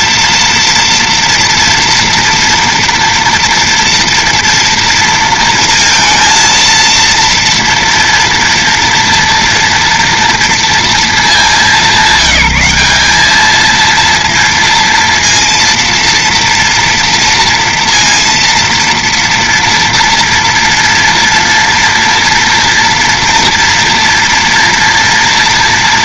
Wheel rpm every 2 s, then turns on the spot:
230, 230, 230, 230, 230, 230, 200, 230, 230, 230, 230, 230, 230.
none